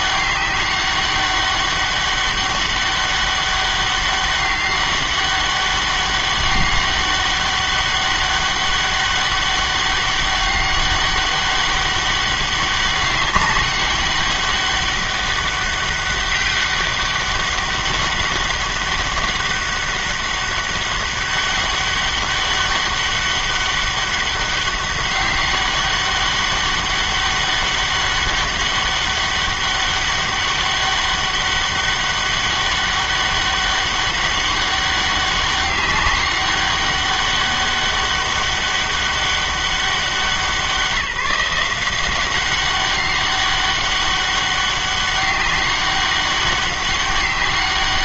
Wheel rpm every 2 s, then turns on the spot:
200, 200, 200, 200, 200, 200, 200, 200, 200, 200, 200, 200, 200, 200, 200, 200, 200, 200, 200, 200, 170, 190, 200, 200.
none